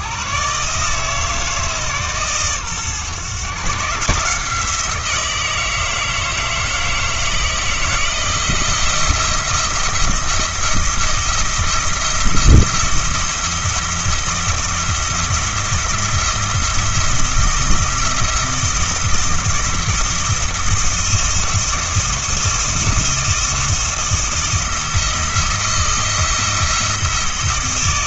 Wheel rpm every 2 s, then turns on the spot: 150, 130, 170, 160, 170, 170, 170, 170, 170, 170, 160, 170, 170, 170.
none